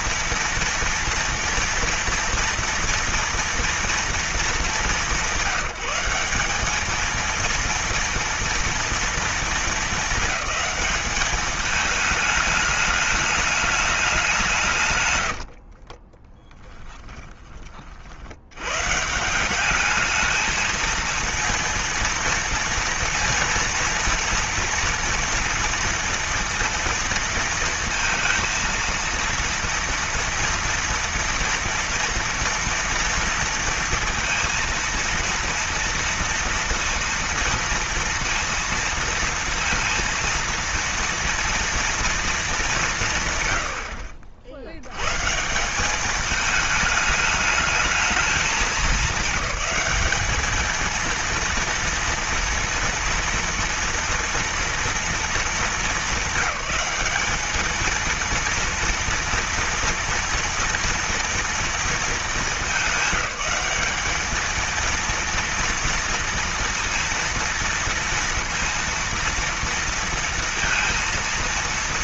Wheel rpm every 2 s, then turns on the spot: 240, 230, 200, 210, 230, 210, 210, 150, 10, 140, 220, 230, 230, 230, 230, 230, 230, 230, 230, 230, 230, 170, 100, 210, 210, 230, 230, 230, 200, 230, 230, 210, 230, 230, 230, 230.
14-18